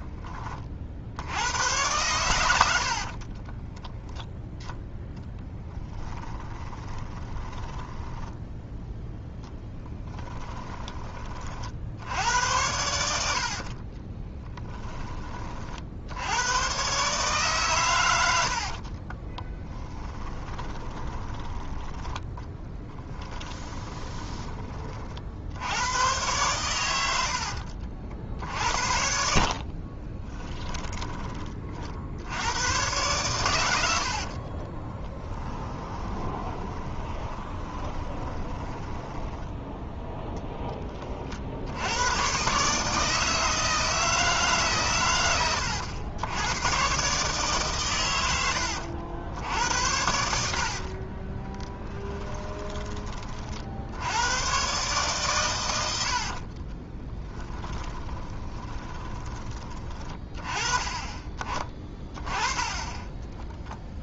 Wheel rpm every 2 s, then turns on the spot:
50, 70, 0, 20, 0, 20, 80, 10, 120, 60, 30, 20, 30, 100, 60, 10, 110, 30, 20, 10, 20, 150, 140, 120, 90, 50, 20, 120, 30, 20, 20, 10.
2-4 6-8 10-12 18-24 30-32 34-40 50-52 56-60